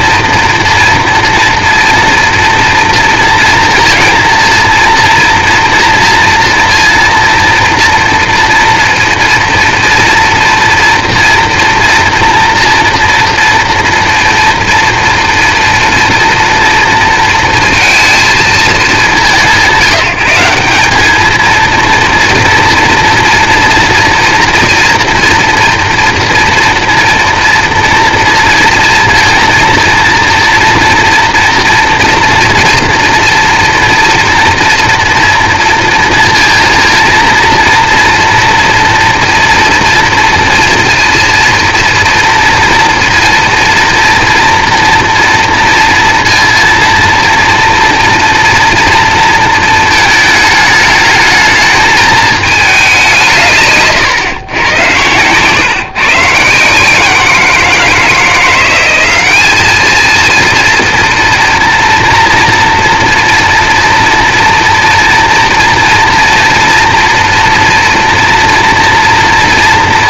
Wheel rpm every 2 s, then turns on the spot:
230, 230, 230, 230, 230, 240, 240, 240, 240, 180, 210, 230, 230, 230, 230, 230, 240, 230, 230, 230, 230, 230, 230, 230, 230, 210, 190, 120, 160, 190, 230, 230, 230, 240, 240.
none